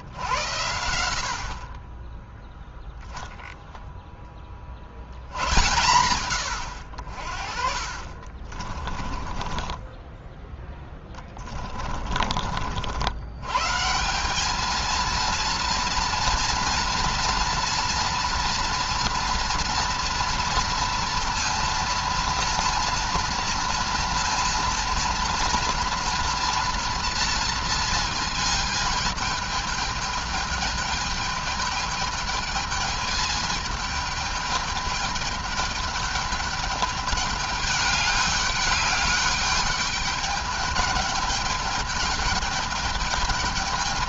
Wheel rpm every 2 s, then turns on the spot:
80, 0, 40, 90, 30, 20, 60, 210, 230, 230, 230, 230, 230, 230, 220, 210, 220, 210, 210, 200, 210, 210.
8-10